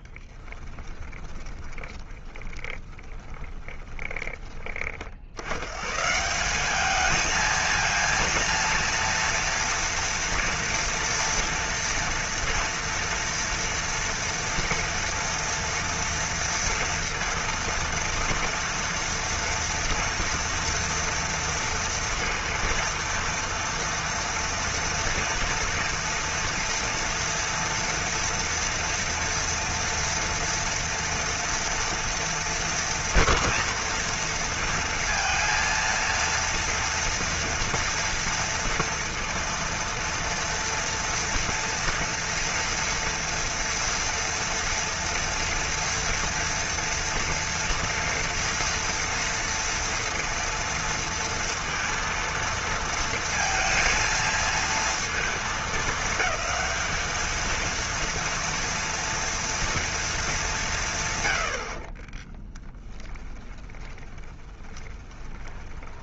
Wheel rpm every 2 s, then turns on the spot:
20, 10, 30, 200, 230, 240, 230, 230, 230, 240, 230, 230, 230, 230, 230, 230, 240, 230, 230, 230, 230, 230, 230, 230, 230, 230, 230, 230, 220, 240, 180, 20, 20.
0-4 62-66